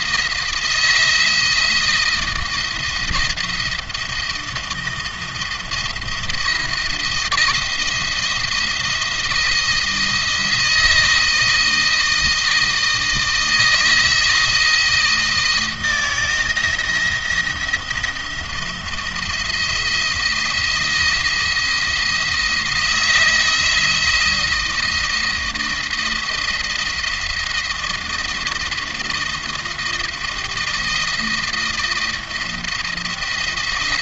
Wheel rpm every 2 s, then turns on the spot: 170, 170, 170, 170, 170, 160, 160, 160, 170, 170, 170, 160, 170, 170, 170, 160, 170.
none